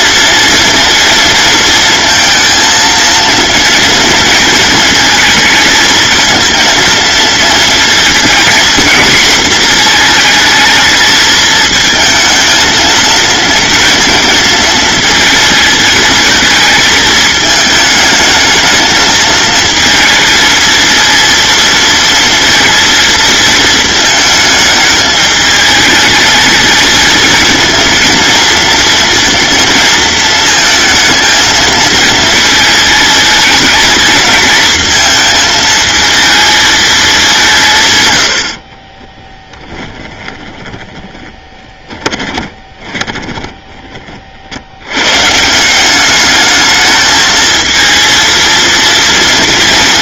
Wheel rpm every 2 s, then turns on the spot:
230, 230, 230, 230, 230, 220, 230, 220, 220, 220, 230, 230, 220, 220, 230, 230, 220, 220, 220, 50, 20, 20, 70, 210, 230.
38-44